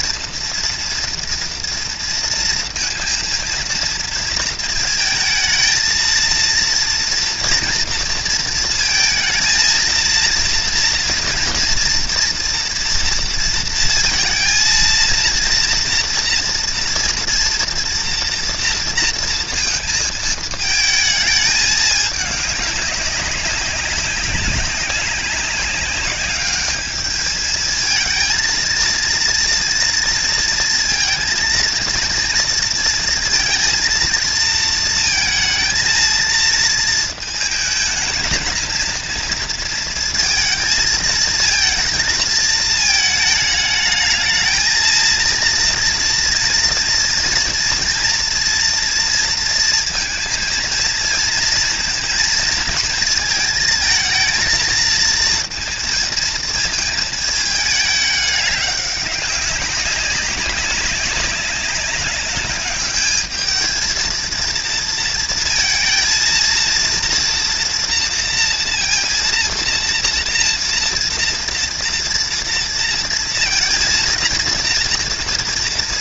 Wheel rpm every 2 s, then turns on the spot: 230, 230, 230, 230, 230, 230, 230, 230, 230, 230, 220, 200, 190, 210, 230, 230, 230, 230, 220, 230, 230, 220, 220, 230, 230, 230, 220, 230, 220, 200, 200, 210, 230, 230, 230, 230, 230, 230.
none